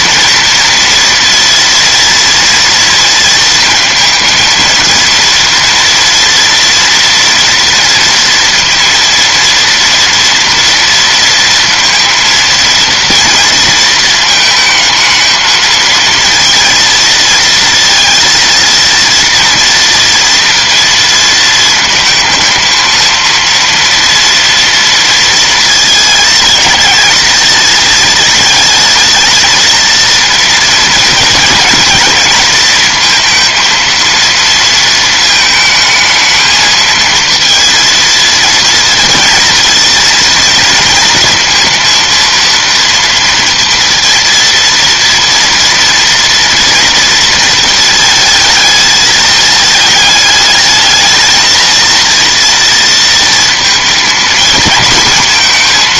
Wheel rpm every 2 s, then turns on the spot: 230, 230, 230, 230, 230, 230, 230, 220, 230, 230, 230, 230, 230, 220, 220, 230, 220, 230, 220, 230, 230, 230, 230, 230, 220, 220, 230, 230.
none